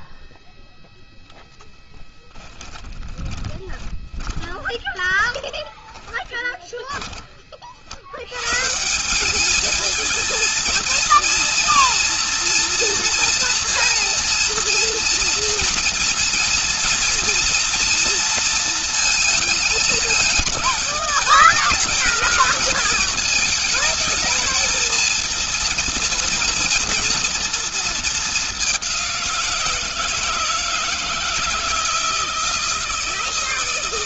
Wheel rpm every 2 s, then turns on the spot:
0, 20, 20, 20, 170, 230, 230, 230, 230, 220, 220, 220, 230, 230, 180, 160, 170.
2-6